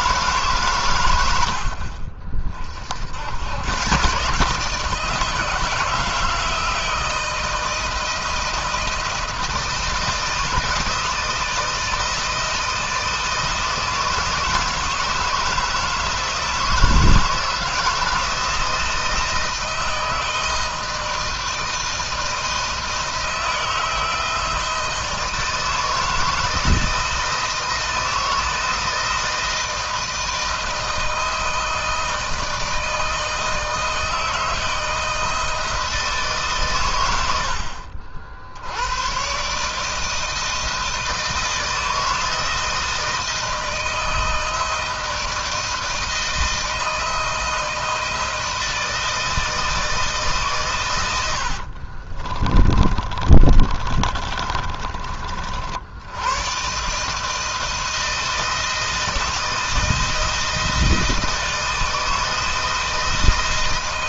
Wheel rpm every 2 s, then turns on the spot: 130, 50, 150, 160, 160, 170, 160, 160, 160, 160, 160, 160, 160, 160, 160, 160, 160, 160, 130, 80, 160, 160, 160, 160, 160, 130, 30, 30, 120, 160, 160, 160.
52-56